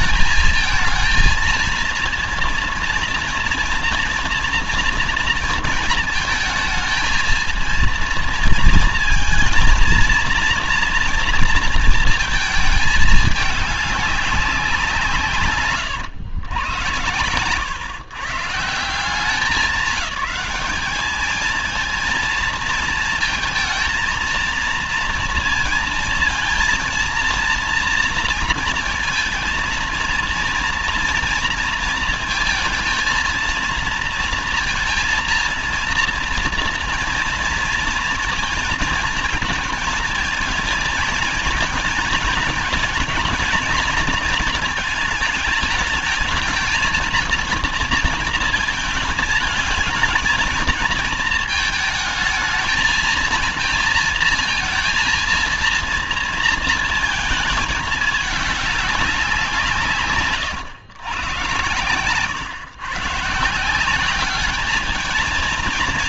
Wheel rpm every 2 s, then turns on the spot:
220, 230, 230, 220, 230, 230, 220, 190, 110, 160, 200, 230, 230, 230, 230, 230, 220, 230, 230, 230, 220, 230, 220, 220, 230, 220, 220, 220, 230, 210, 120, 130, 200.
none